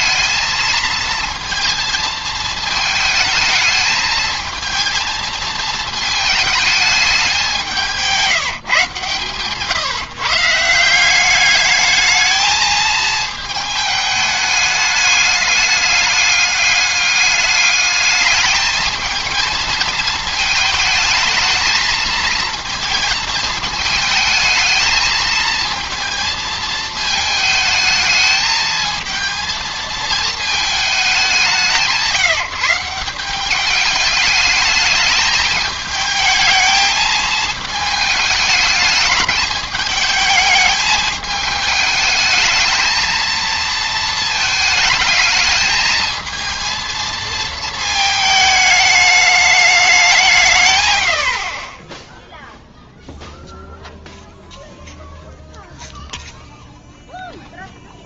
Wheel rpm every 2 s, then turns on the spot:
220, 220, 220, 220, 150, 160, 220, 210, 200, 220, 220, 220, 220, 220, 220, 220, 170, 210, 220, 210, 210, 220, 220, 230, 210, 120, 0, 0, 0.
none